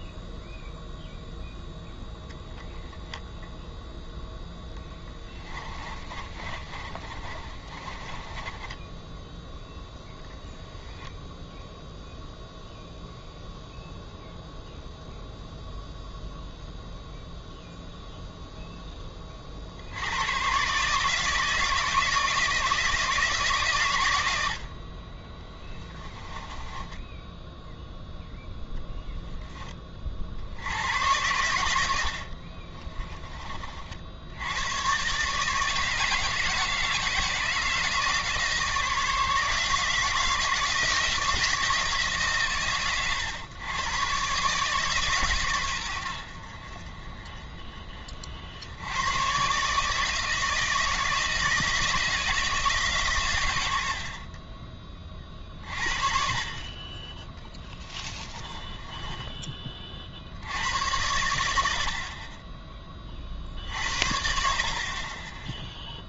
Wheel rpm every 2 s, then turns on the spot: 0, 0, 0, 30, 20, 0, 0, 0, 0, 0, 130, 170, 70, 10, 0, 70, 50, 90, 160, 160, 170, 130, 140, 50, 70, 160, 160, 30, 30, 20, 80, 20, 50.
6-10 26-28 32-34 58-60